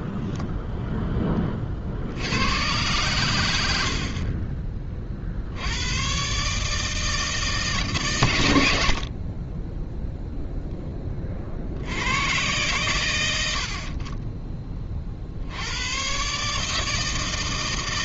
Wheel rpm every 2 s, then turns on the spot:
30, 80, 80, 150, 30, 60, 50, 100, 160.
none